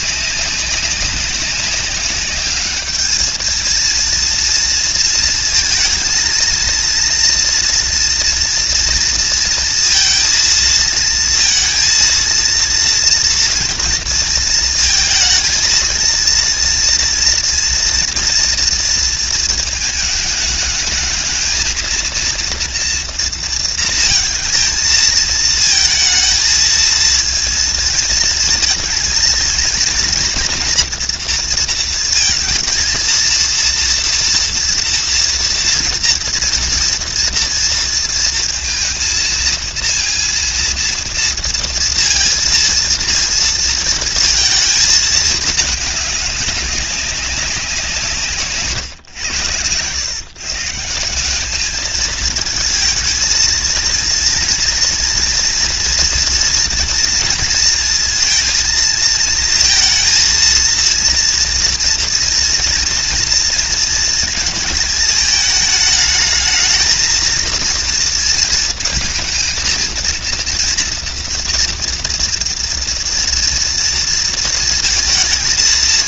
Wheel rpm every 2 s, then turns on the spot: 200, 210, 230, 240, 240, 230, 230, 230, 230, 230, 220, 230, 230, 230, 230, 230, 230, 230, 230, 230, 230, 230, 220, 200, 130, 160, 230, 230, 230, 220, 230, 230, 220, 220, 230, 230, 230, 220.
none